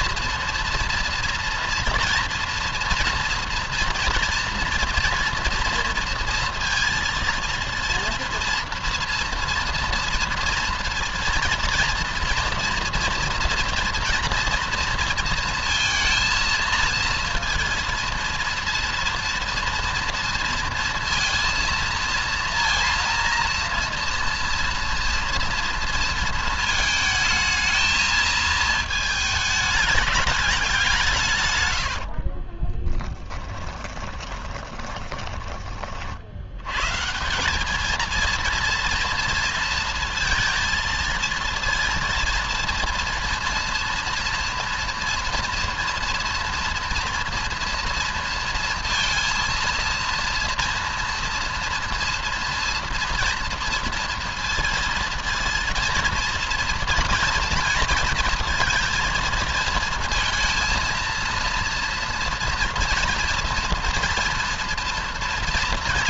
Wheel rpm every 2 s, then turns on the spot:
230, 230, 230, 230, 230, 230, 230, 230, 230, 230, 230, 230, 230, 220, 220, 170, 20, 20, 130, 230, 230, 230, 230, 230, 230, 230, 230, 230, 230, 230, 230, 230, 240.
32-36